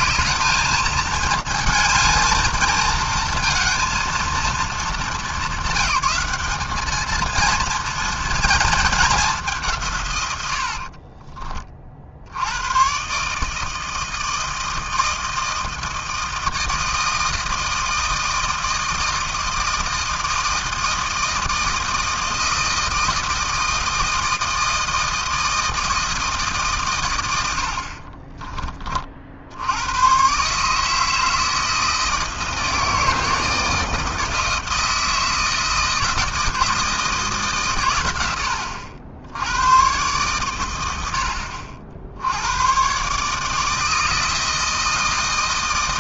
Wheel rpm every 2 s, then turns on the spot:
210, 220, 220, 200, 230, 90, 90, 160, 160, 160, 160, 160, 160, 150, 20, 140, 160, 160, 160, 100, 110, 100, 160.
28-30